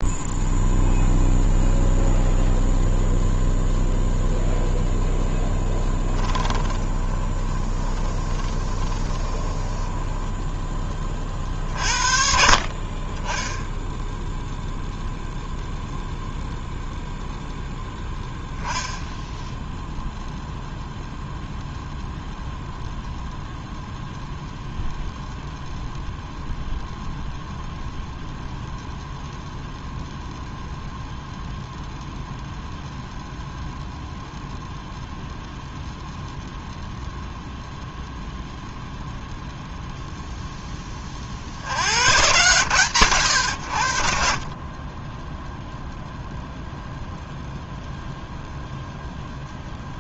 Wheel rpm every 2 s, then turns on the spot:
0, 0, 0, 20, 20, 30, 20, 0, 0, 10, 0, 0, 0, 0, 0, 0, 0, 0, 0, 0, 20, 110, 10, 0, 0.
6-10